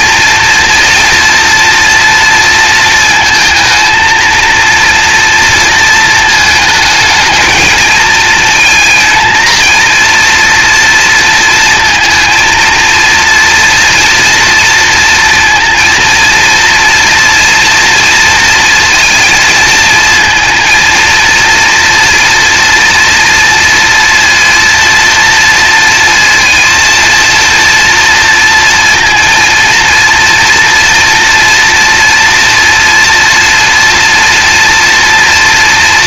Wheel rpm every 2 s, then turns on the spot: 230, 230, 230, 220, 230, 230, 230, 240, 230, 230, 230, 240, 230, 230, 230, 230, 230, 230.
none